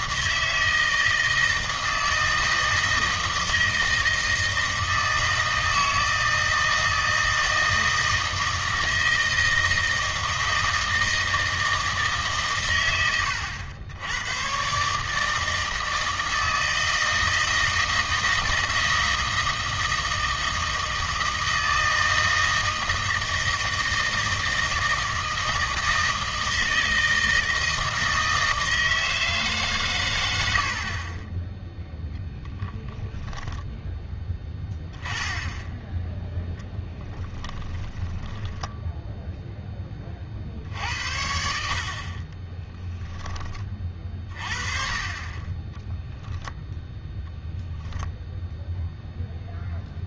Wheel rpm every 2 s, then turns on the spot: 160, 160, 160, 160, 160, 160, 130, 130, 160, 160, 160, 160, 160, 160, 160, 70, 0, 10, 10, 10, 60, 10, 30, 0, 0.
38-40 42-44